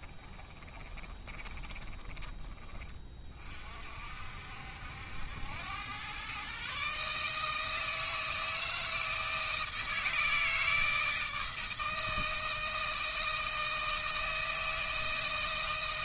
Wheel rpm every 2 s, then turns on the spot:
20, 20, 70, 140, 160, 160, 160, 160.
0-2